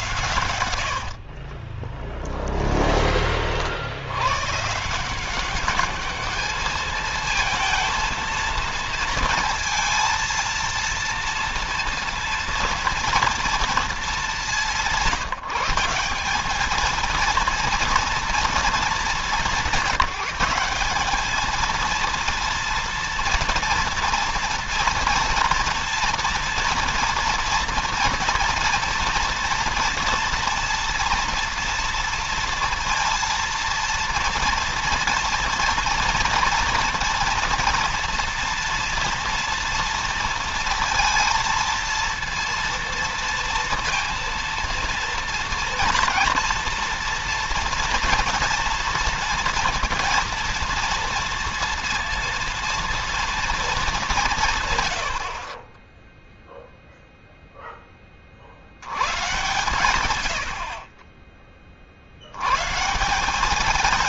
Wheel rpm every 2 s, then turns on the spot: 80, 20, 150, 220, 230, 230, 240, 170, 220, 220, 200, 230, 240, 230, 230, 230, 230, 230, 230, 230, 230, 230, 230, 230, 230, 230, 230, 120, 0, 100, 40, 150.
0-2